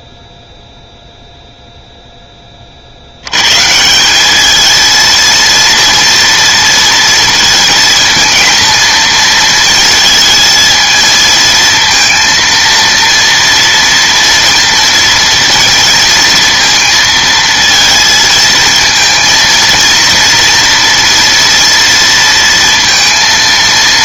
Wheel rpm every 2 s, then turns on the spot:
0, 40, 220, 230, 230, 220, 230, 230, 230, 220, 230, 230.
none